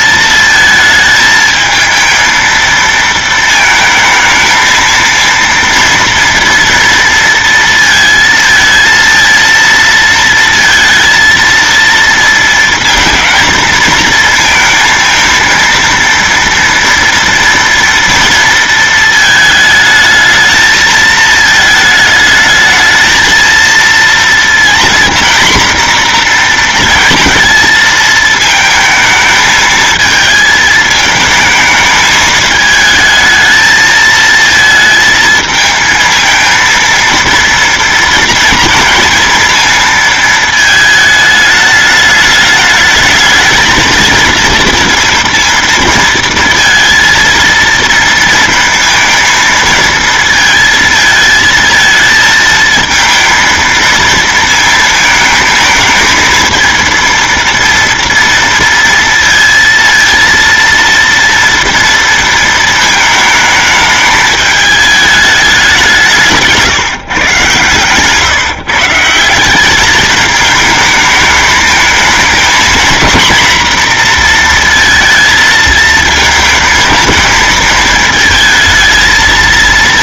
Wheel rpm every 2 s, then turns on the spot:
220, 220, 220, 230, 230, 230, 230, 220, 230, 230, 220, 220, 230, 240, 220, 220, 220, 220, 220, 230, 220, 210, 220, 230, 230, 230, 220, 230, 220, 230, 230, 230, 210, 160, 140, 210, 220, 230, 220, 220.
none